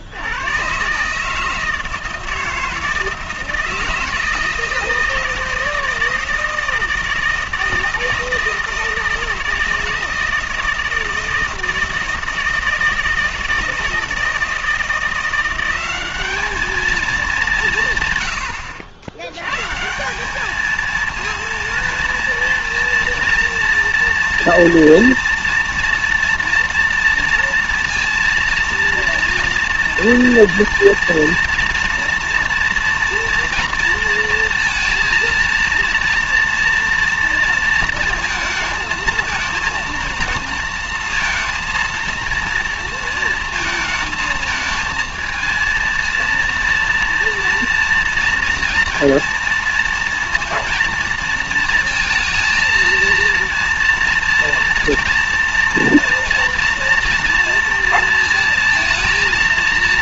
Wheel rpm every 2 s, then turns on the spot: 130, 160, 160, 160, 160, 160, 160, 170, 220, 90, 220, 240, 230, 230, 230, 230, 230, 230, 240, 220, 230, 230, 220, 230, 230, 230, 230, 230, 230, 230.
none